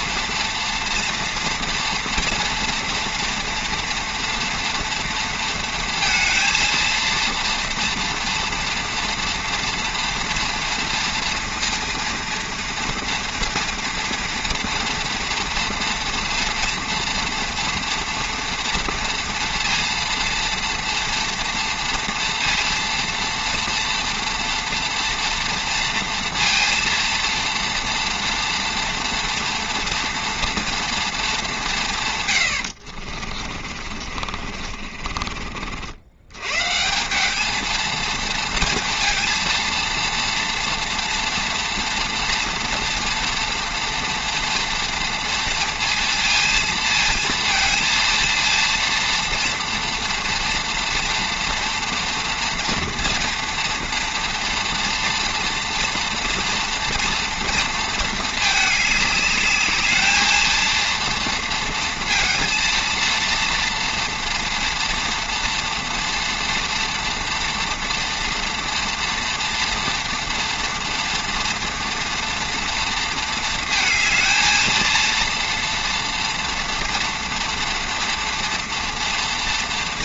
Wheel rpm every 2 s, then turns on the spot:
230, 230, 230, 230, 230, 230, 230, 230, 230, 230, 230, 230, 230, 230, 230, 230, 90, 50, 140, 230, 230, 230, 230, 230, 230, 230, 230, 230, 230, 220, 230, 230, 230, 240, 230, 230, 230, 230, 230, 230.
32-36